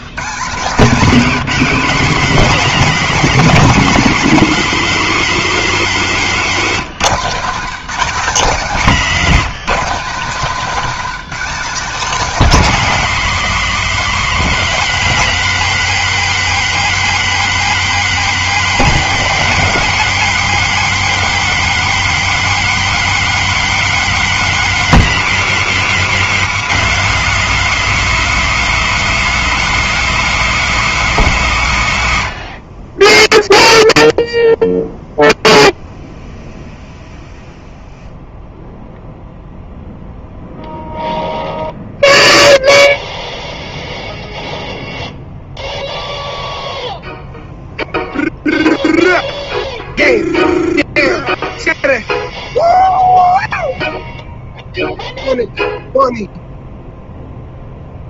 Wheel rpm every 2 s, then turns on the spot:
150, 230, 240, 210, 210, 210, 250, 230, 240, 240, 240, 240, 210, 190, 230, 230, 90, 0, 0, 0, 0, 0, 0, 0, 0, 0, 0, 0, 0.
none